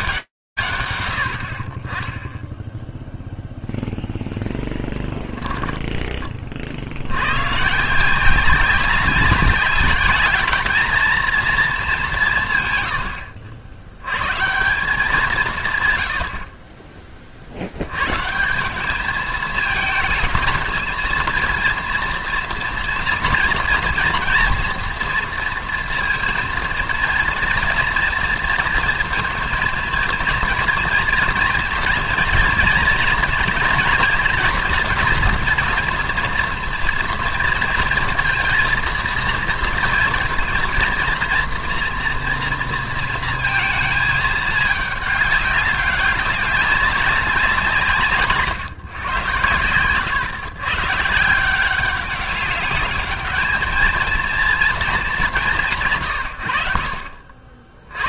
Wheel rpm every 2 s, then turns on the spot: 90, 0, 10, 70, 190, 220, 100, 190, 30, 210, 220, 230, 230, 230, 230, 230, 230, 230, 230, 230, 230, 230, 210, 200, 130, 150, 210, 220, 60.
4-6